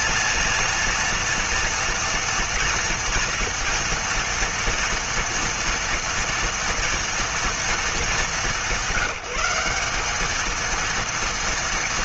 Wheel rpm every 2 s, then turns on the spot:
230, 230, 230, 240, 200, 210.
none